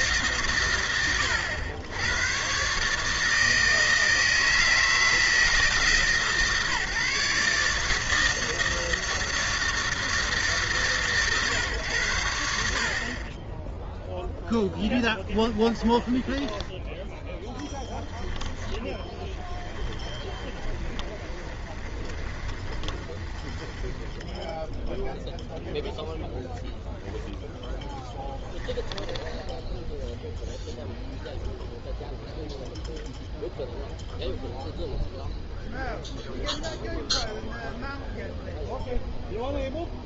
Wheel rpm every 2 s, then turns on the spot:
100, 160, 150, 150, 160, 110, 0, 20, 10, 20, 30, 20, 0, 10, 10, 0, 0, 0, 0, 0.
14-24 26-30